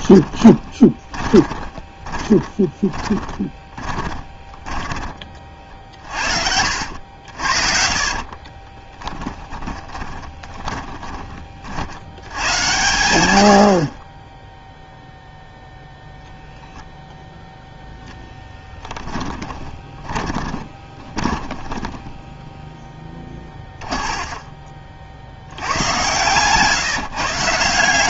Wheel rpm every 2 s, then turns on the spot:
10, 20, 20, 60, 30, 20, 110, 0, 0, 10, 20, 10, 40, 140.
0-12 18-26